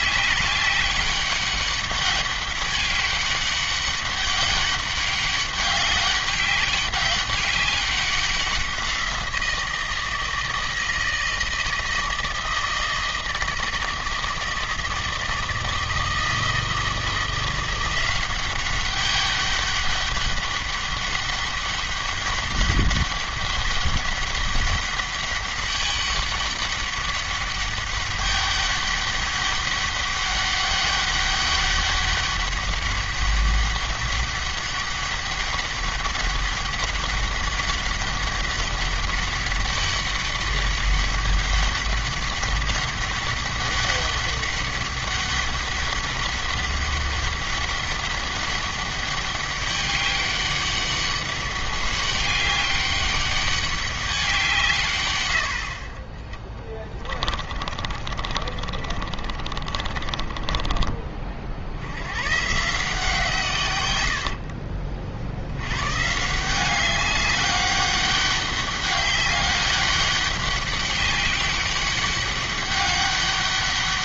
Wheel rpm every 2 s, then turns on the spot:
200, 200, 200, 200, 180, 160, 160, 160, 160, 190, 200, 200, 200, 200, 200, 200, 200, 200, 200, 200, 200, 200, 200, 200, 200, 200, 200, 150, 20, 40, 30, 150, 50, 190, 200, 200, 200.
56-60 64-66